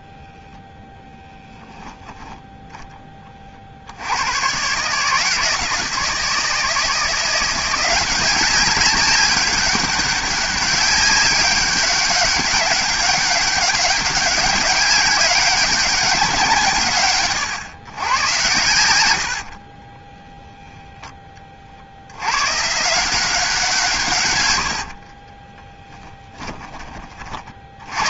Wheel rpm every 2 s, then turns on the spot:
0, 10, 130, 160, 190, 190, 200, 200, 170, 120, 10, 160, 60, 30.
24-26